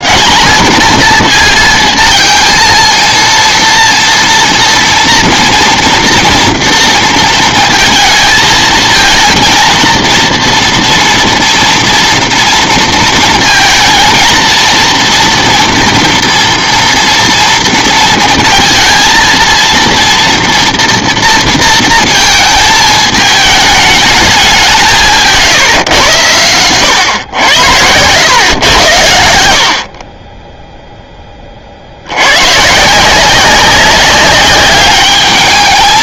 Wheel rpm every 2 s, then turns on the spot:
230, 230, 230, 230, 220, 230, 230, 230, 240, 230, 230, 220, 180, 110, 100, 10, 140, 200.
none